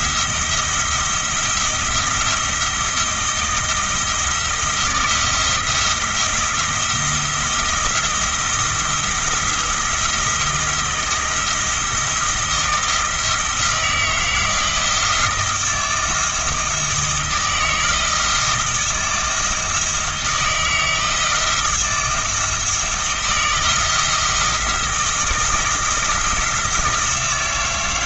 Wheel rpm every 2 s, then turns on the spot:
170, 170, 170, 170, 170, 170, 160, 170, 160, 160, 160, 160, 170, 170.
none